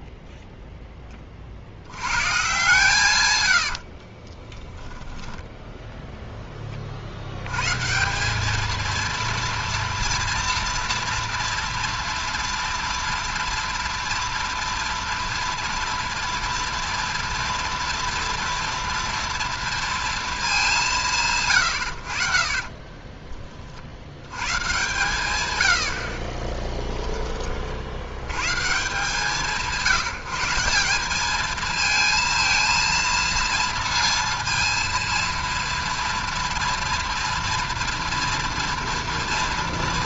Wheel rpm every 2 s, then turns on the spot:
0, 130, 20, 20, 210, 230, 230, 230, 230, 230, 210, 40, 110, 20, 140, 180, 230, 230, 230, 230.
4-6 22-24 26-28